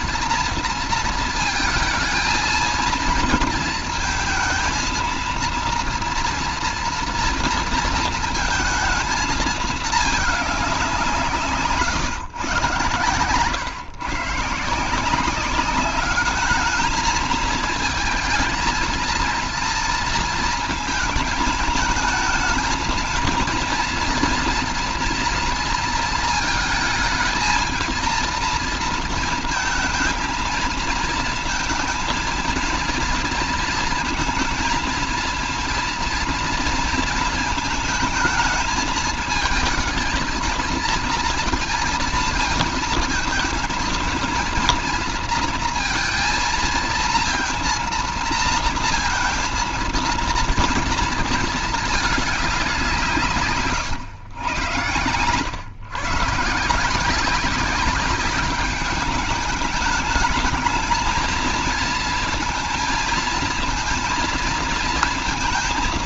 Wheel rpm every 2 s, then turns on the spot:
230, 230, 230, 240, 230, 210, 120, 150, 210, 220, 230, 220, 230, 220, 230, 220, 230, 230, 230, 220, 230, 230, 230, 230, 230, 230, 200, 110, 150, 200, 220, 220, 230.
none